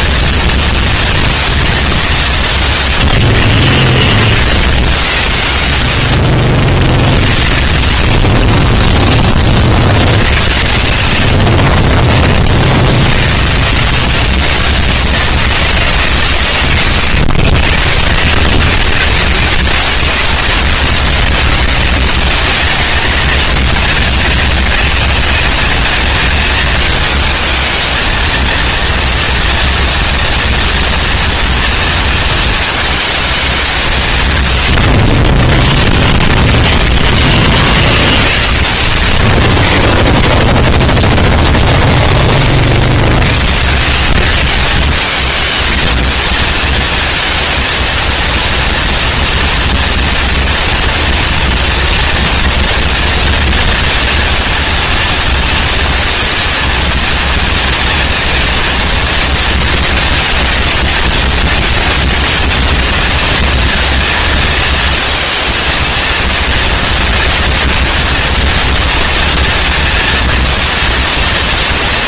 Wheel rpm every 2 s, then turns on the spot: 230, 150, 80, 60, 40, 60, 30, 180, 150, 80, 160, 180, 200, 210, 230, 230, 230, 130, 10, 50, 10, 20, 150, 220, 230, 230, 230, 230, 230, 230, 220, 230, 230, 230, 230, 230.
6-10 36-38